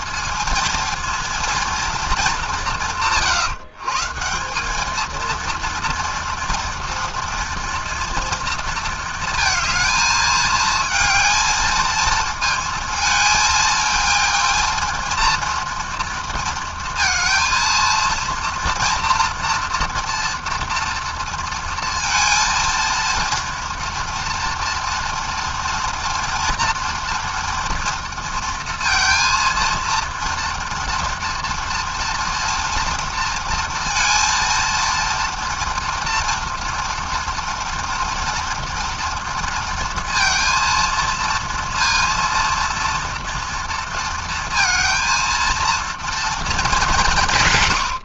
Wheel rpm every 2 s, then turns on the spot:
230, 150, 230, 230, 230, 230, 220, 230, 230, 230, 230, 230, 230, 240, 230, 230, 230, 230, 230, 230, 230, 230, 230, 170.
none